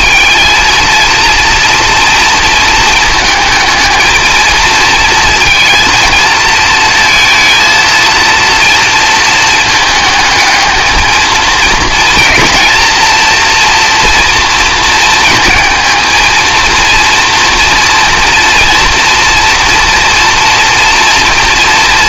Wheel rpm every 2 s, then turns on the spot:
230, 220, 220, 230, 230, 220, 230, 230, 230, 240, 230.
none